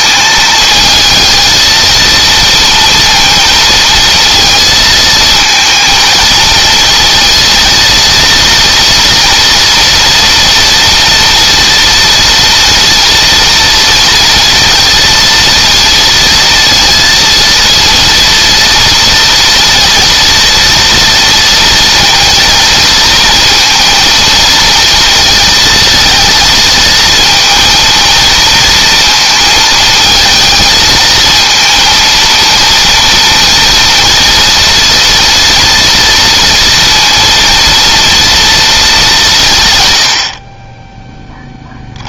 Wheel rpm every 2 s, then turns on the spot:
220, 230, 220, 220, 230, 230, 240, 230, 230, 230, 230, 230, 230, 230, 230, 220, 230, 230, 230, 220, 20.
none